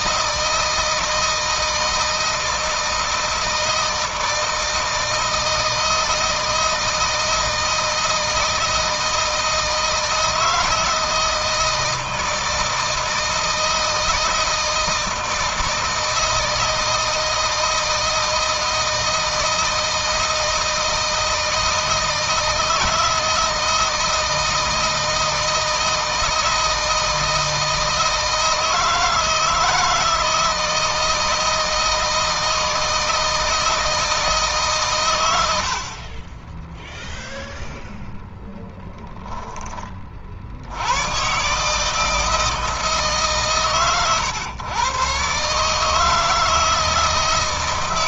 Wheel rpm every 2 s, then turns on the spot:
160, 160, 160, 160, 160, 160, 160, 160, 160, 160, 160, 160, 160, 160, 160, 160, 160, 130, 10, 10, 100, 150, 120, 160.
none